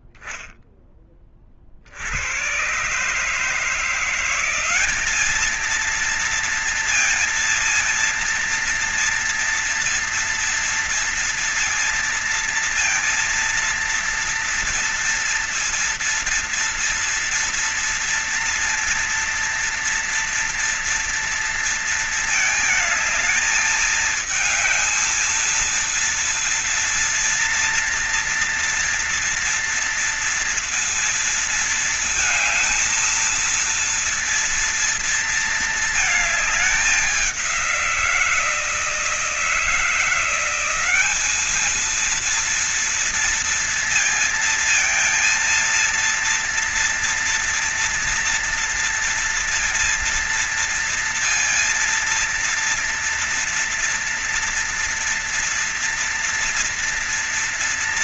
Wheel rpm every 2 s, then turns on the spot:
0, 70, 170, 230, 230, 230, 230, 230, 230, 230, 230, 230, 220, 230, 240, 230, 230, 230, 220, 180, 170, 220, 230, 230, 230, 230, 230, 230, 240.
none